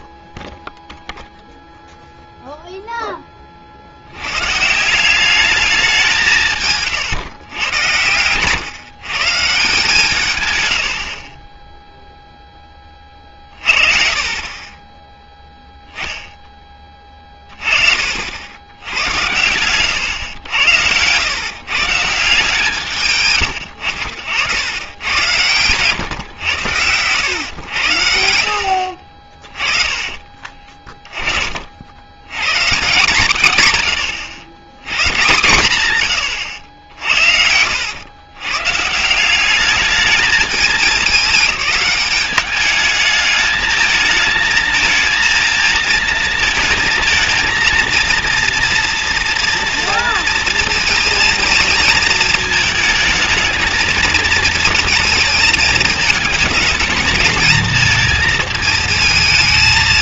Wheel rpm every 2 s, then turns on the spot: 0, 0, 150, 150, 140, 90, 30, 10, 30, 110, 130, 100, 120, 100, 30, 50, 130, 130, 80, 200, 200, 220, 220, 230, 230, 220, 220, 220, 220, 200.
6-8 18-20 28-30